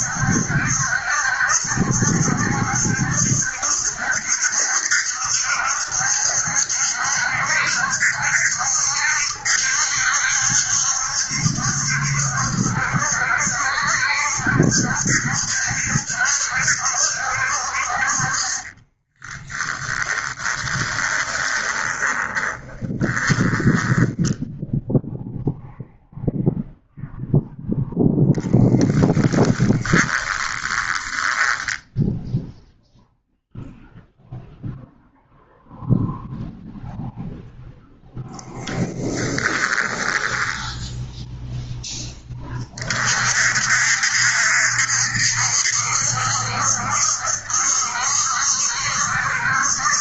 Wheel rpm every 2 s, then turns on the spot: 70, 70, 70, 70, 70, 70, 70, 70, 70, 30, 20, 20, 0, 0, 10, 20, 0, 0, 0, 10, 0, 40, 70, 70, 70.
18-24 28-32 38-40